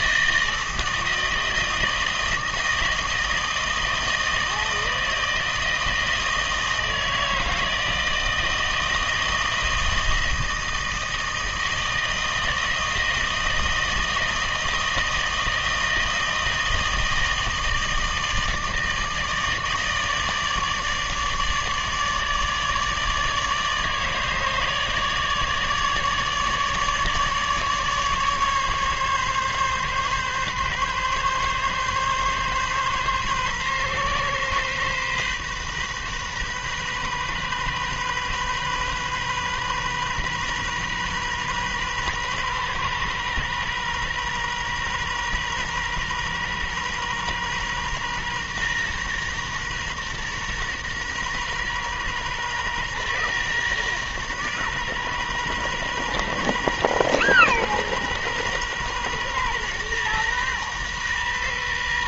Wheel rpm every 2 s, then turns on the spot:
160, 160, 160, 160, 160, 160, 160, 160, 160, 160, 150, 150, 150, 150, 140, 130, 130, 130, 130, 130, 130, 120, 120, 120, 120, 120, 120, 120, 120, 120, 120.
none